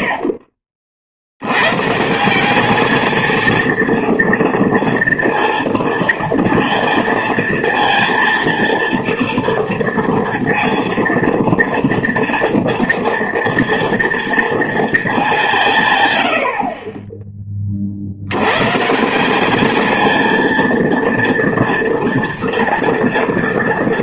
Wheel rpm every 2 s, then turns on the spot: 50, 210, 230, 230, 230, 230, 230, 230, 60, 130, 230, 230.
none